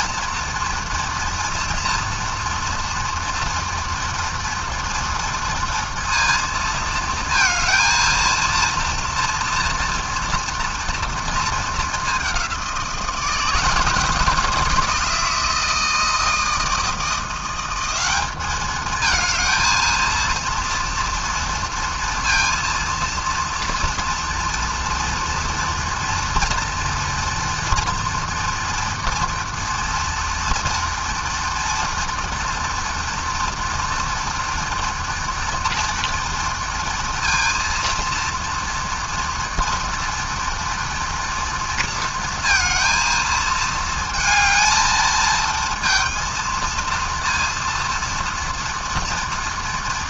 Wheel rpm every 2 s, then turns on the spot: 230, 230, 230, 220, 230, 230, 160, 160, 170, 220, 230, 230, 240, 230, 230, 230, 230, 230, 230, 230, 230, 220, 220, 230, 240.
none